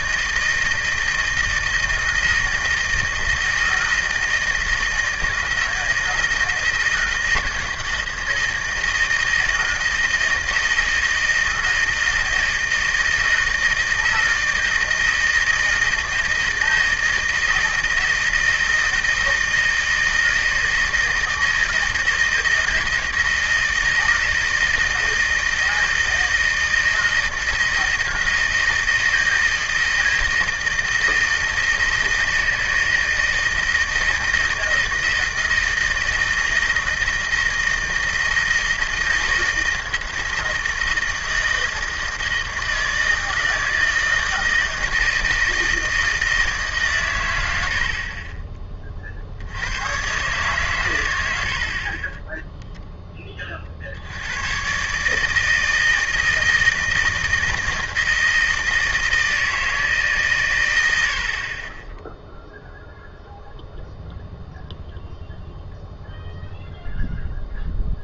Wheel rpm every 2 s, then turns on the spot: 160, 160, 160, 160, 160, 160, 160, 160, 160, 160, 160, 160, 160, 160, 160, 160, 160, 160, 160, 160, 160, 160, 160, 160, 40, 130, 30, 80, 160, 160, 150, 10, 0, 0.
48-50